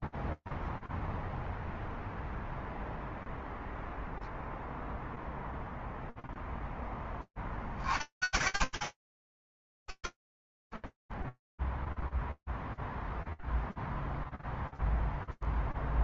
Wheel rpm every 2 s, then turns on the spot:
0, 0, 0, 0, 90, 10, 0, 0.
none